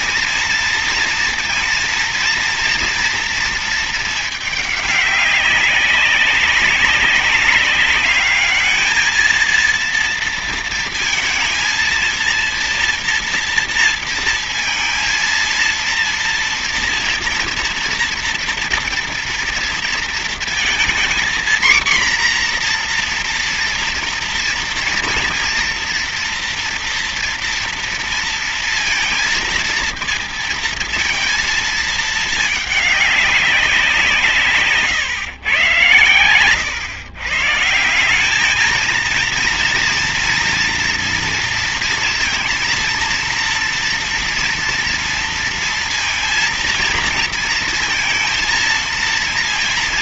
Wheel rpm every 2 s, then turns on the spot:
230, 230, 210, 190, 210, 230, 230, 220, 230, 230, 230, 240, 230, 230, 230, 230, 210, 140, 110, 220, 230, 230, 230, 230, 230.
none